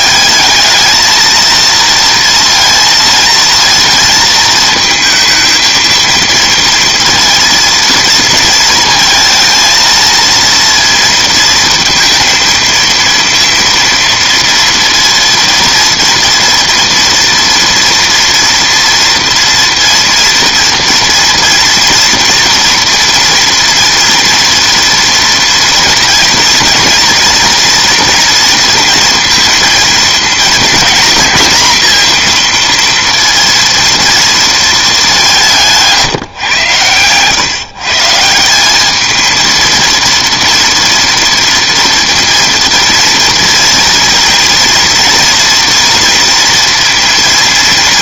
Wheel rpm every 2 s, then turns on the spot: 220, 230, 220, 230, 220, 230, 230, 230, 230, 230, 230, 230, 230, 220, 230, 230, 230, 220, 130, 190, 230, 230, 240, 230.
none